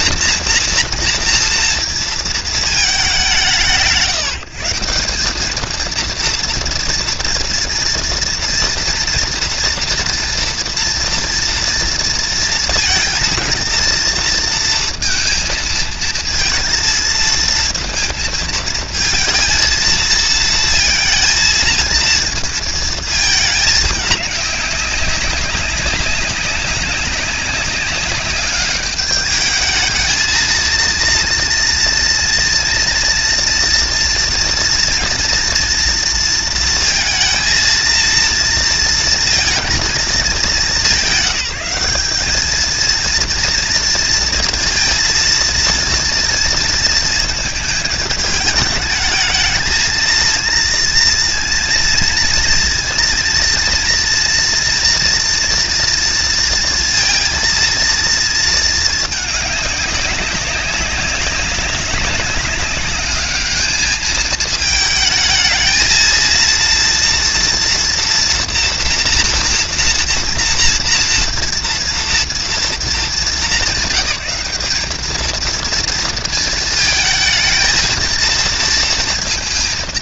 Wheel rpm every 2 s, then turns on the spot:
230, 170, 180, 230, 230, 230, 230, 230, 230, 230, 220, 220, 200, 190, 210, 230, 230, 230, 230, 230, 190, 230, 230, 230, 220, 230, 230, 230, 230, 220, 200, 200, 220, 230, 230, 230, 210, 220, 220, 230.
none